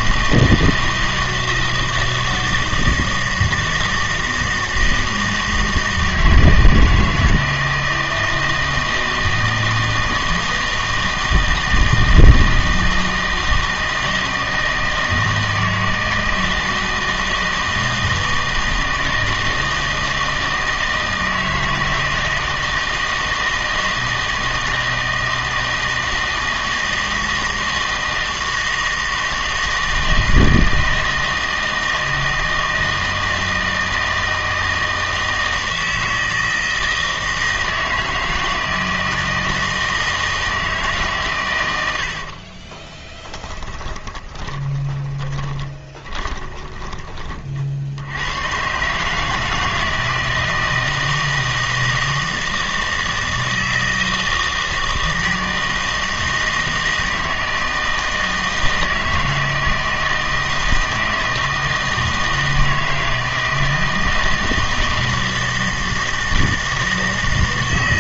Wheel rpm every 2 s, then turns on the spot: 160, 160, 160, 160, 160, 160, 160, 160, 160, 160, 160, 160, 160, 160, 160, 160, 160, 160, 160, 160, 150, 20, 20, 20, 130, 160, 160, 160, 160, 160, 160, 160, 160, 160.
42-48